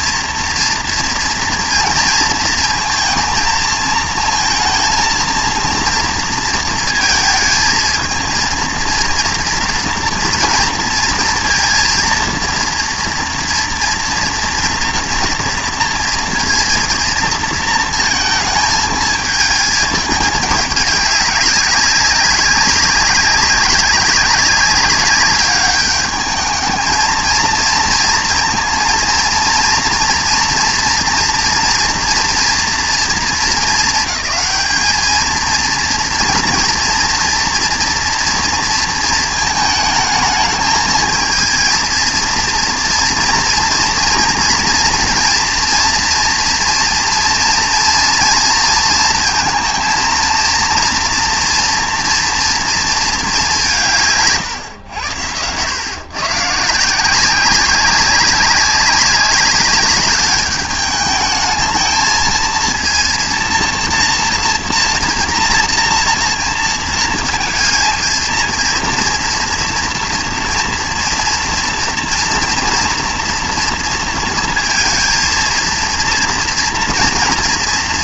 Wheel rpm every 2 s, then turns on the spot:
230, 230, 230, 230, 230, 230, 230, 230, 230, 220, 210, 200, 200, 220, 230, 230, 230, 220, 230, 230, 220, 230, 230, 230, 230, 230, 230, 120, 160, 200, 210, 230, 230, 230, 230, 230, 230, 230, 240.
none